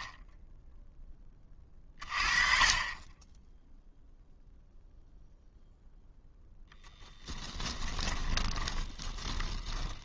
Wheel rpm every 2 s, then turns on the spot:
20, 20, 0, 10, 20.
6-10